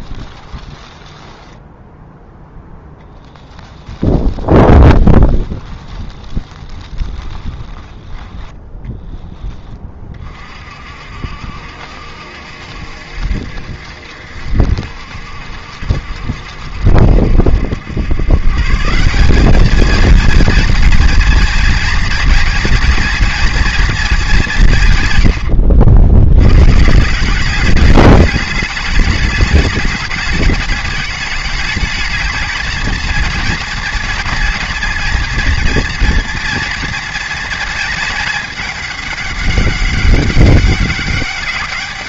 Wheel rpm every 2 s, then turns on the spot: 10, 10, 20, 20, 10, 50, 70, 70, 70, 170, 240, 230, 140, 160, 210, 210, 230, 230, 230, 200, 200.
0-2 4-8